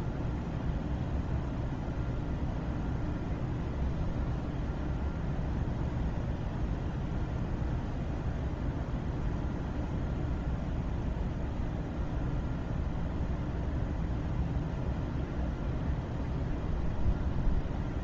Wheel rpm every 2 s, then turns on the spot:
0, 0, 0, 0, 0, 0, 0, 0, 0.
none